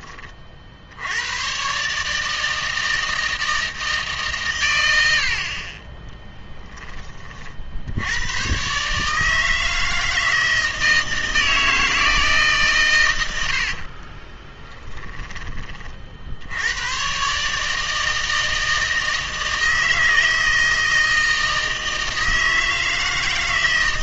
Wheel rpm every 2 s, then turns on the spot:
70, 160, 100, 20, 140, 160, 130, 10, 100, 160, 160, 160.
14-16